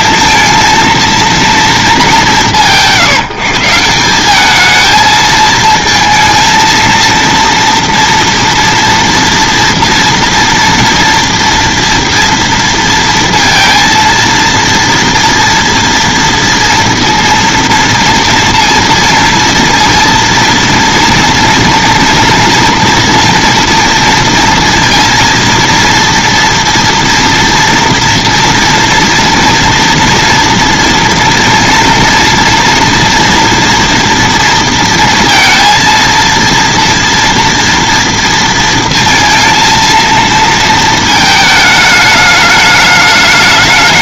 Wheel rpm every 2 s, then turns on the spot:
230, 150, 210, 230, 230, 230, 230, 230, 230, 230, 230, 240, 230, 230, 230, 230, 230, 230, 230, 230, 230, 210.
none